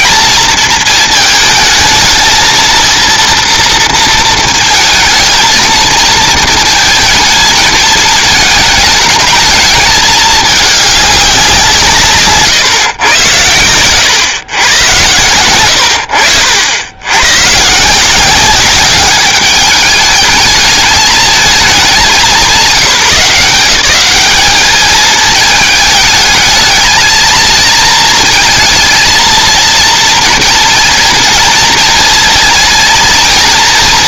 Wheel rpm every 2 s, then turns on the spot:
230, 230, 230, 230, 220, 210, 150, 110, 80, 200, 210, 200, 210, 220, 220, 230, 230.
none